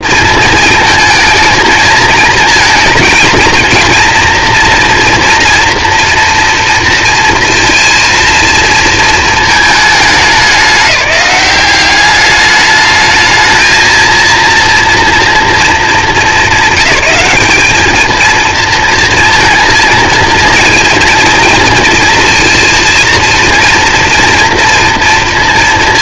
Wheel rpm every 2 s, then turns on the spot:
220, 220, 230, 230, 230, 210, 210, 230, 200, 230, 230, 230, 230.
none